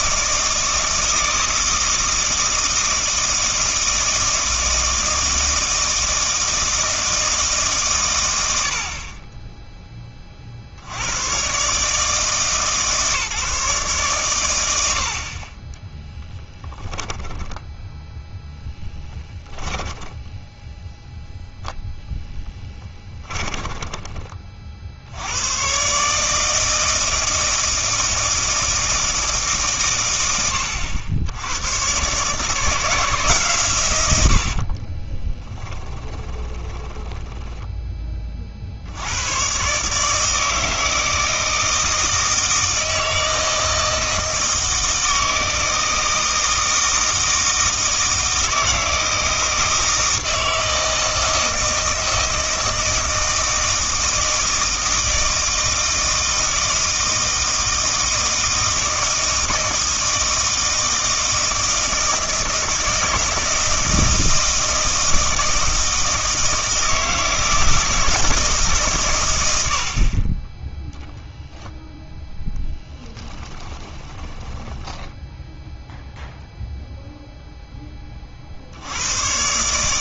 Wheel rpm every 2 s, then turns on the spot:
160, 160, 160, 160, 60, 70, 150, 90, 10, 10, 0, 20, 50, 160, 160, 90, 160, 40, 20, 70, 160, 160, 160, 160, 160, 160, 160, 160, 160, 160, 160, 160, 160, 160, 150, 0, 20, 10, 0, 70.
22-24 34-38 74-76